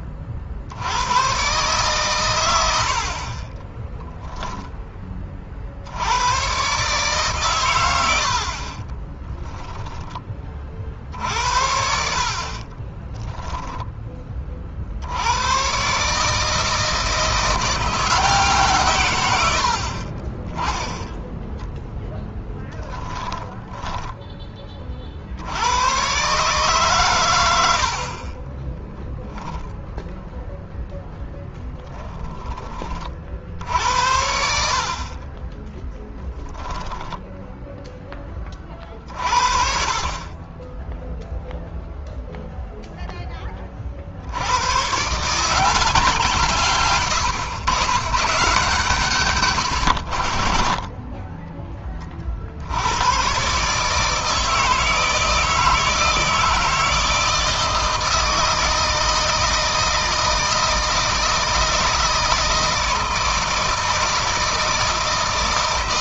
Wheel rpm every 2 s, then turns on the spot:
80, 70, 10, 130, 40, 40, 20, 50, 160, 140, 10, 10, 30, 130, 10, 0, 40, 50, 10, 40, 20, 0, 110, 130, 150, 30, 90, 160, 160, 160, 160, 160, 160.
8-10 12-14 22-24 34-36